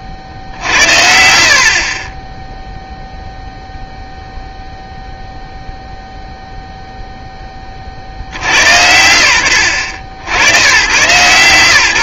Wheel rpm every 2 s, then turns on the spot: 60, 0, 0, 0, 90, 110.
none